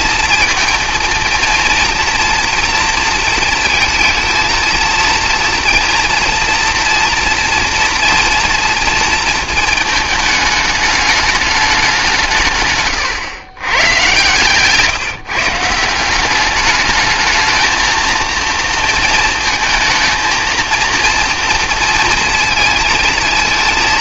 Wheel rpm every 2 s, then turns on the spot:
230, 230, 230, 240, 230, 210, 130, 140, 210, 230, 230, 230.
none